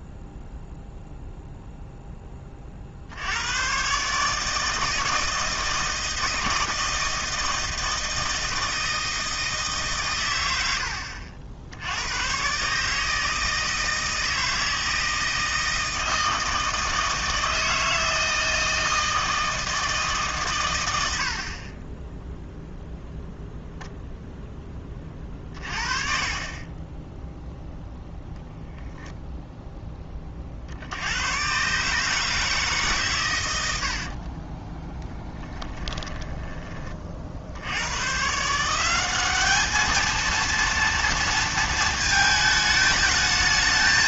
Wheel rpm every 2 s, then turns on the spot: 0, 40, 160, 160, 160, 90, 140, 160, 160, 160, 100, 0, 10, 20, 0, 60, 150, 20, 20, 170, 230, 220.
26-28 34-36